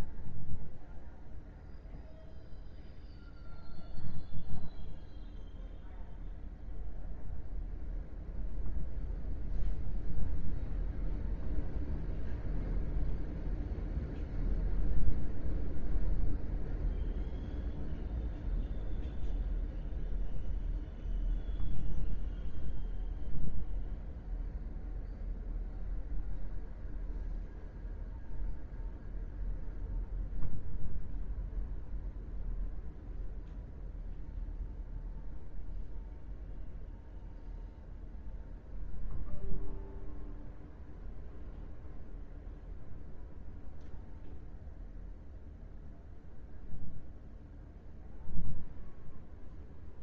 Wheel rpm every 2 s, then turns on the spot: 0, 0, 0, 0, 0, 0, 0, 0, 0, 0, 0, 0, 0, 0, 0, 0, 0, 0, 0, 0, 0, 0, 0, 0, 0.
none